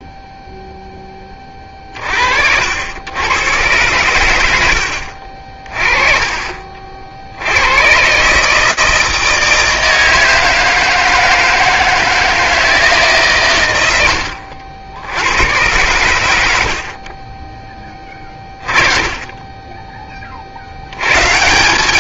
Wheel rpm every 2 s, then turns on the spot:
0, 70, 90, 40, 160, 160, 160, 70, 50, 30, 50.
none